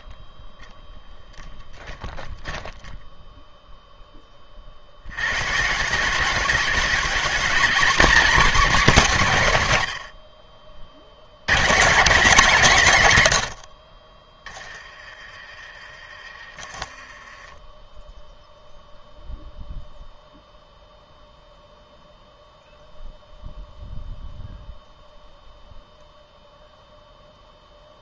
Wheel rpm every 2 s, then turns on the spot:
10, 10, 60, 210, 250, 70, 200, 30, 20, 0, 0, 0, 0, 0.
2-4 14-16